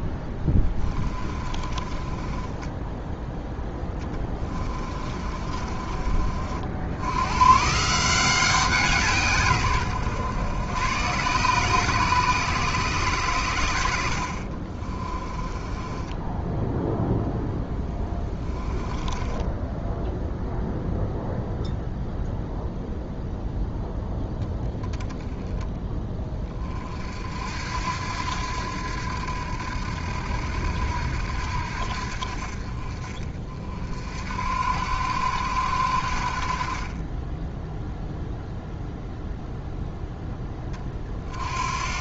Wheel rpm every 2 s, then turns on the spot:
20, 10, 30, 70, 170, 100, 130, 40, 10, 20, 0, 0, 10, 40, 90, 80, 50, 80, 40, 0, 20.
0-6 14-16